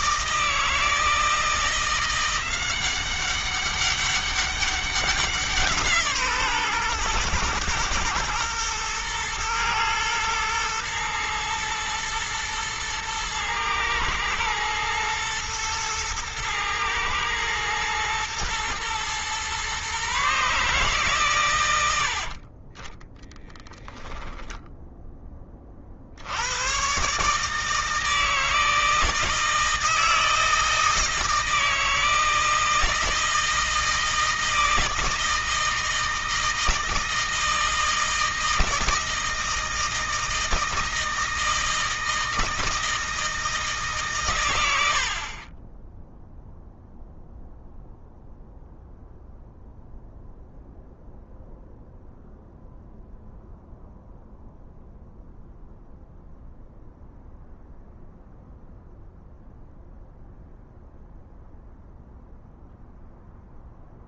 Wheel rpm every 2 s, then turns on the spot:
160, 190, 190, 130, 120, 120, 120, 120, 110, 120, 140, 20, 10, 130, 160, 160, 160, 160, 160, 160, 160, 160, 70, 0, 0, 0, 0, 0, 0, 0, 0, 0.
22-24